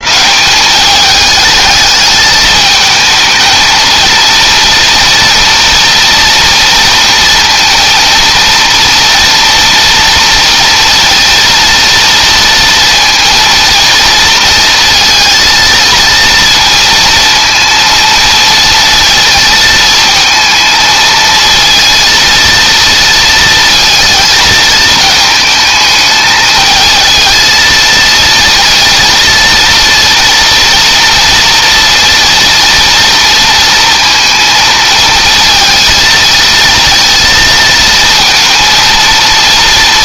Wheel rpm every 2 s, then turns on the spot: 210, 220, 230, 230, 240, 230, 230, 230, 230, 220, 230, 230, 220, 220, 230, 230, 230, 220, 230, 230.
none